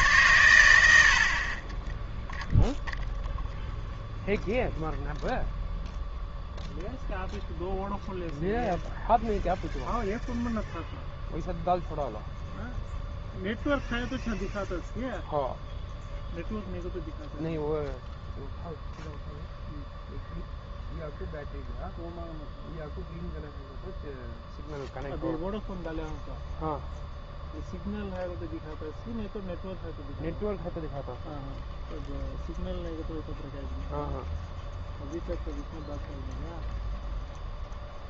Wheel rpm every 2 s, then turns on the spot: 80, 0, 0, 0, 0, 0, 0, 0, 0, 0, 0, 0, 0, 0, 0, 0, 0, 0, 0.
none